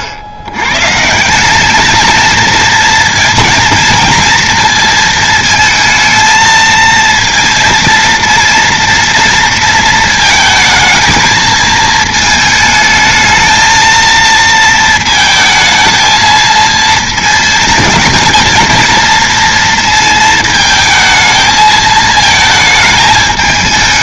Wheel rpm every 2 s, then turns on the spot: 110, 230, 230, 230, 230, 220, 220, 230, 220, 220, 220, 220.
none